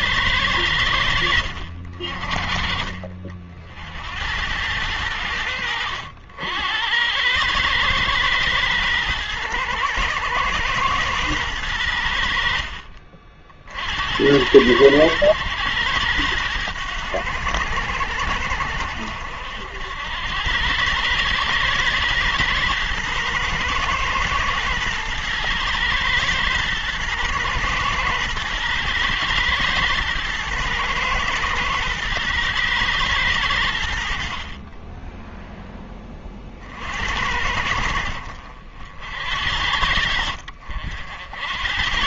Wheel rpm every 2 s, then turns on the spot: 80, 50, 90, 100, 110, 110, 60, 100, 90, 70, 110, 120, 110, 110, 120, 110, 100, 10, 70, 70, 80.
none